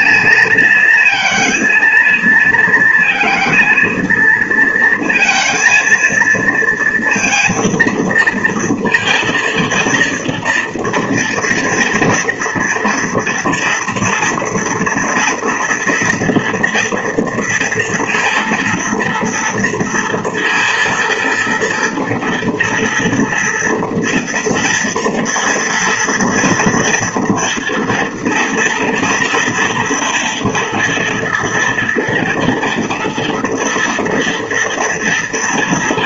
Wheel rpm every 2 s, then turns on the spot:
230, 230, 230, 230, 230, 230, 230, 230, 240, 230, 230, 230, 230, 230, 230, 230, 240, 240.
none